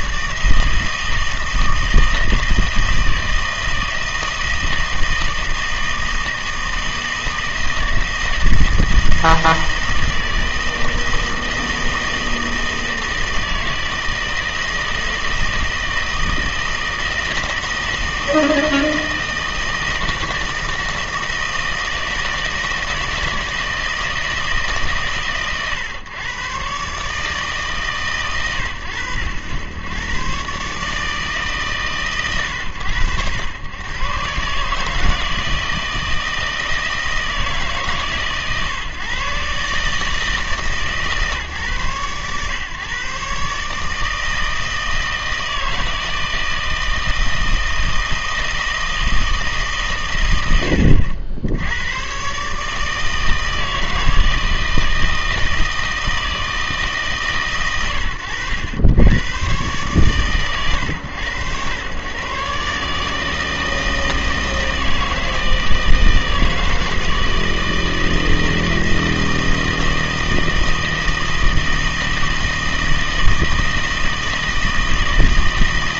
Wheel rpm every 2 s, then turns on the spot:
160, 160, 160, 160, 160, 160, 160, 160, 160, 160, 160, 160, 150, 130, 110, 140, 100, 150, 160, 140, 150, 130, 160, 160, 160, 90, 150, 160, 160, 90, 110, 140, 160, 160, 160, 160, 160, 160.
none